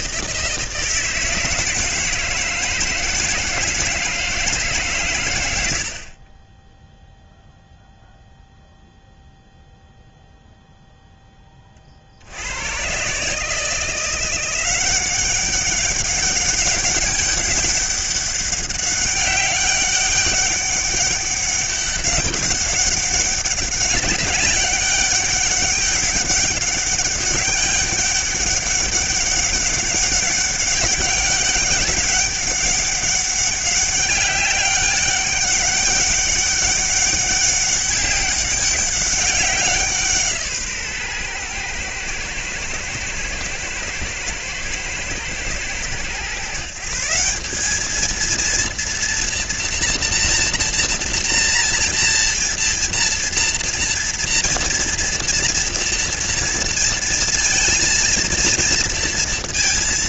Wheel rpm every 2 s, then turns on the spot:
160, 160, 140, 10, 0, 0, 100, 180, 200, 200, 200, 200, 200, 200, 200, 190, 200, 200, 200, 200, 150, 110, 110, 150, 230, 240, 230, 240, 230, 230.
6-8